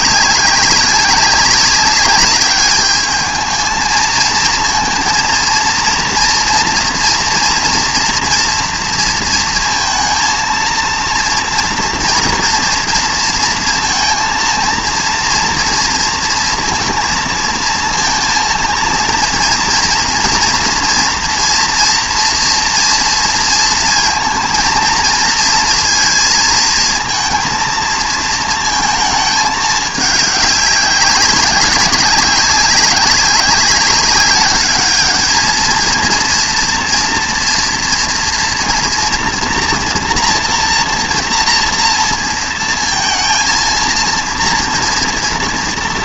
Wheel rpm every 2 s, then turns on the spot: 190, 210, 230, 230, 230, 230, 230, 230, 230, 230, 240, 230, 230, 220, 230, 200, 190, 200, 230, 230, 230, 230, 230.
none